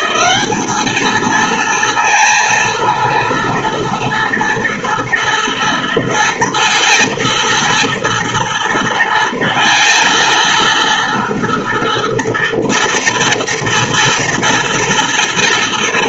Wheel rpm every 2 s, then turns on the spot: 210, 230, 230, 230, 230, 230, 230, 230.
none